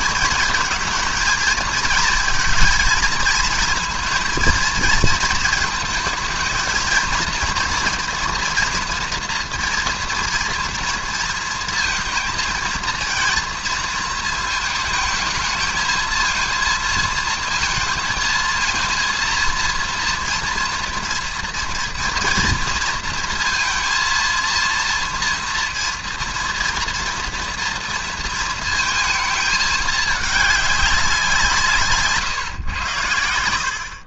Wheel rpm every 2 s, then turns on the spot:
220, 230, 230, 220, 240, 240, 230, 220, 230, 230, 230, 230, 230, 230, 230, 210, 120.
none